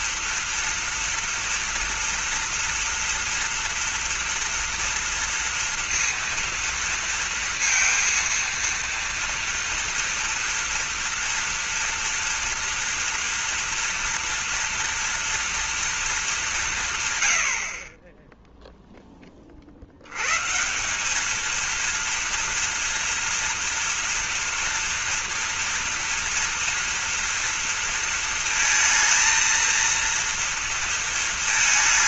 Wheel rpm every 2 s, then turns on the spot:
230, 230, 230, 230, 230, 230, 230, 240, 160, 10, 180, 230, 230, 240, 230, 230.
none